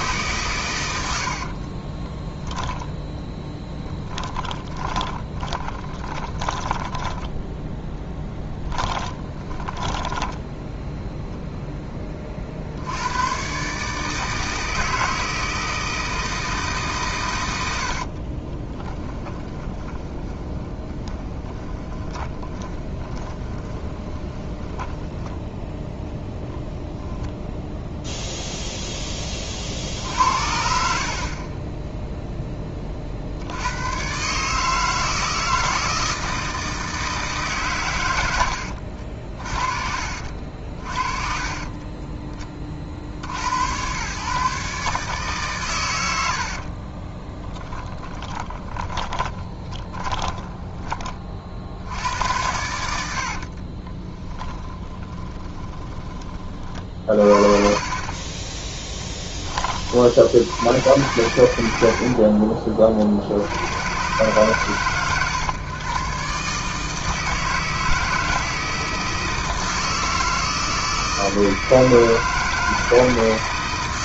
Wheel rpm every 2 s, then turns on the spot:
80, 10, 20, 10, 20, 0, 100, 160, 130, 20, 20, 20, 10, 0, 10, 40, 50, 160, 160, 60, 40, 50, 140, 30, 20, 30, 70, 20, 50, 10, 100, 60, 120, 160, 160, 160, 160.
4-10 18-26 38-40 46-50 52-56